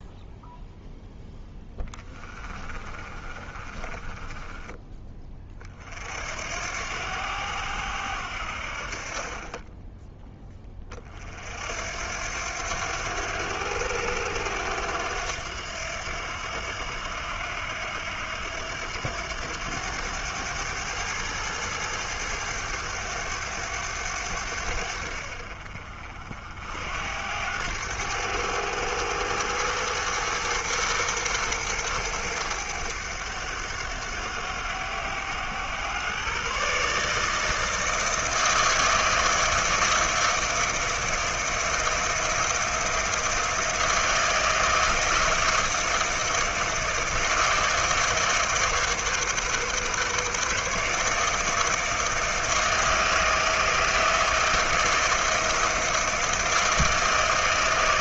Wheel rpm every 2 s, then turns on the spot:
0, 30, 20, 80, 50, 30, 90, 90, 80, 90, 110, 100, 80, 70, 100, 120, 100, 90, 150, 160, 160, 170, 160, 160, 150, 150, 160, 170, 160.
2-4